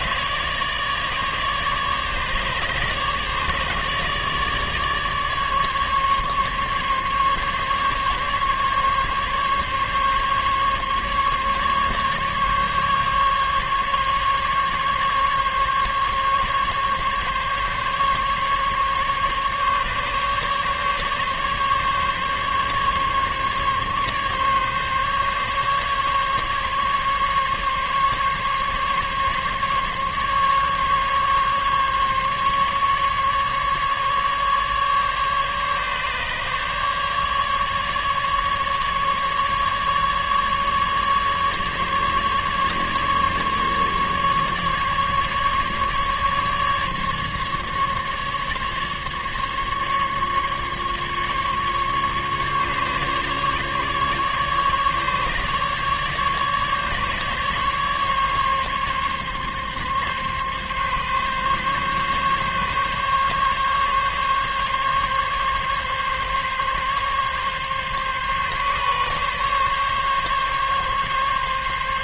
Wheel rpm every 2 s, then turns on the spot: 150, 150, 150, 140, 140, 140, 140, 140, 140, 140, 140, 140, 140, 140, 140, 140, 140, 140, 150, 150, 150, 140, 150, 140, 150, 140, 140, 140, 150, 140, 140, 140, 140, 140, 140, 140.
none